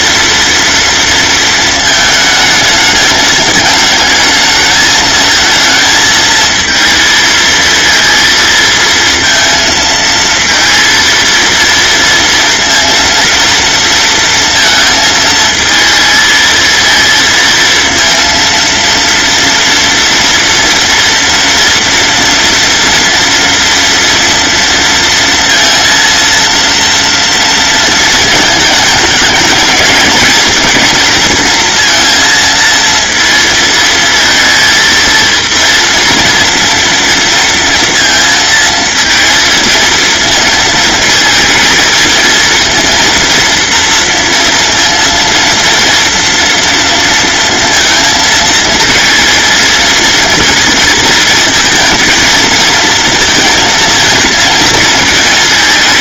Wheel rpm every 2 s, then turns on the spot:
230, 210, 220, 230, 230, 230, 230, 230, 230, 230, 230, 230, 230, 230, 210, 220, 230, 230, 230, 230, 220, 230, 230, 230, 220, 230, 230, 220.
none